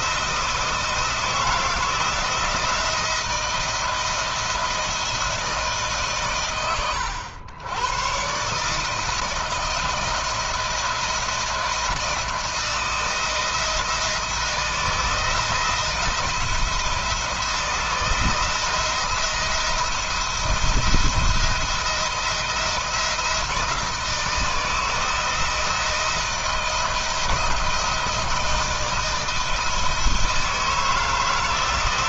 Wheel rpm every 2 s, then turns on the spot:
160, 170, 160, 100, 160, 170, 170, 170, 160, 170, 170, 160, 160, 160, 160, 160.
none